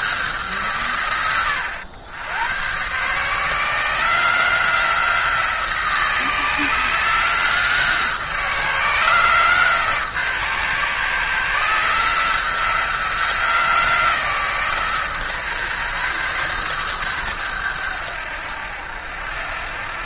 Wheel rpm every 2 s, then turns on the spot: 140, 110, 170, 160, 160, 150, 170, 150, 120, 80.
none